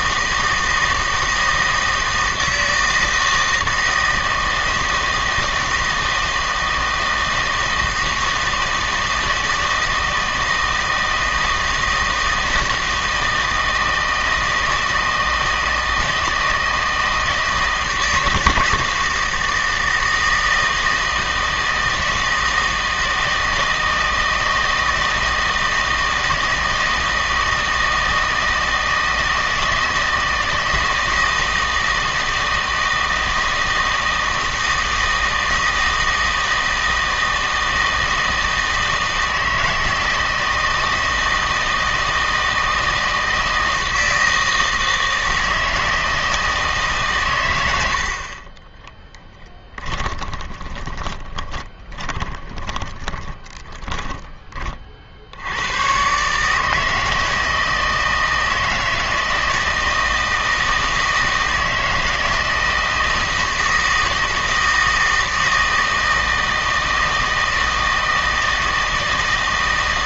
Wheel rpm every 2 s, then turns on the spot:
160, 160, 160, 160, 160, 160, 160, 160, 160, 160, 160, 160, 160, 160, 160, 160, 160, 160, 160, 160, 160, 160, 160, 160, 20, 20, 20, 40, 160, 160, 160, 160, 160, 160, 160.
50-54